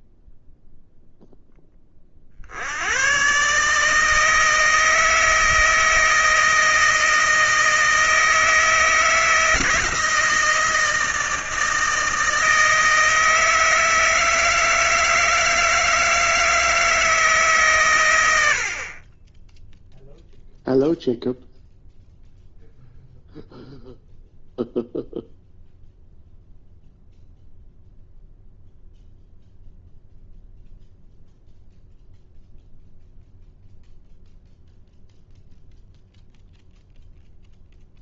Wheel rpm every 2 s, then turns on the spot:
0, 100, 160, 160, 160, 160, 160, 160, 160, 40, 0, 0, 0, 0, 0, 0, 0, 0, 0.
none